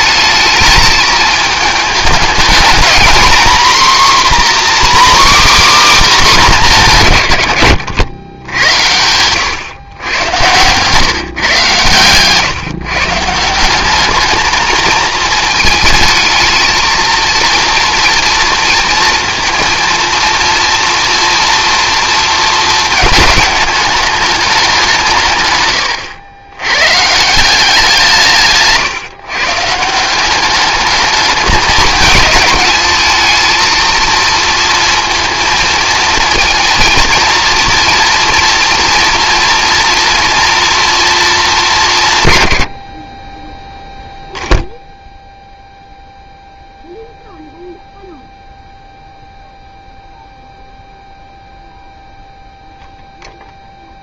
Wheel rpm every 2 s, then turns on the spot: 220, 220, 280, 210, 100, 120, 140, 220, 220, 230, 230, 220, 200, 110, 150, 200, 210, 230, 230, 230, 230, 100, 0, 0, 0, 0, 0.
none